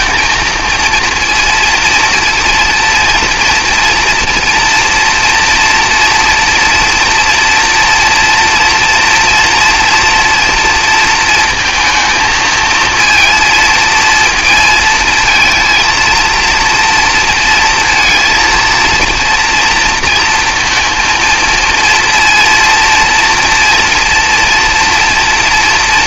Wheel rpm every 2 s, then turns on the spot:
230, 230, 230, 230, 240, 230, 220, 230, 230, 230, 230, 230, 230.
none